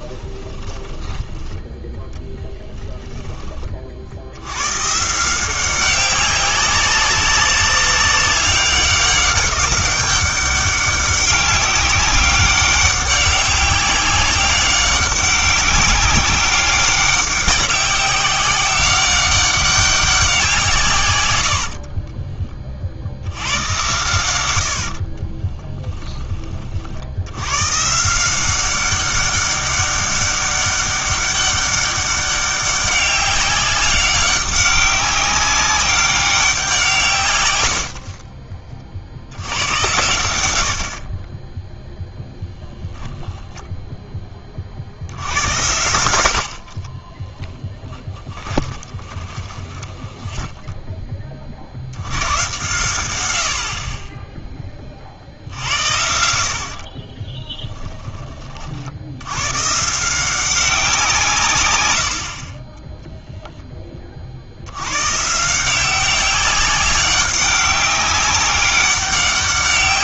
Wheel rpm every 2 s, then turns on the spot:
20, 10, 110, 190, 200, 200, 200, 190, 190, 190, 170, 40, 80, 40, 190, 200, 200, 200, 180, 40, 70, 0, 40, 50, 30, 10, 120, 10, 80, 50, 180, 20, 90, 200, 200.
0-4 24-26 46-52